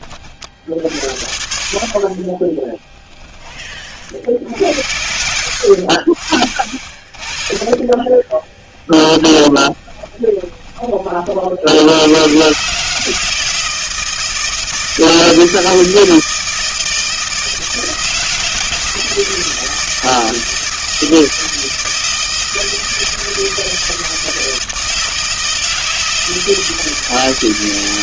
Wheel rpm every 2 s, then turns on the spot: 50, 20, 70, 50, 20, 20, 120, 160, 160, 170, 160, 160, 160, 160.
2-4 6-12